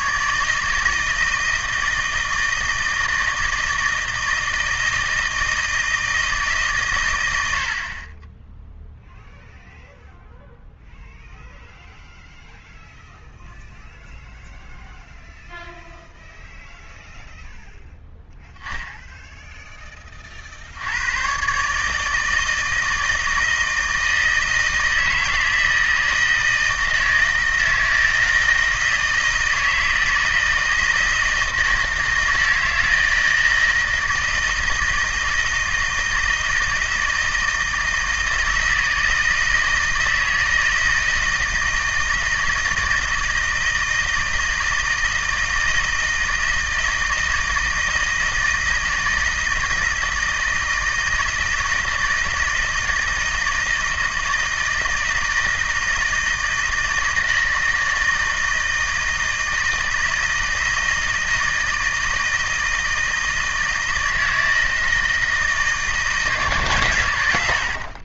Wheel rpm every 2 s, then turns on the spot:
160, 160, 160, 120, 0, 0, 0, 0, 0, 0, 90, 160, 160, 160, 160, 160, 160, 160, 160, 160, 160, 160, 160, 160, 160, 160, 160, 160, 160, 160, 160, 160, 160, 120.
none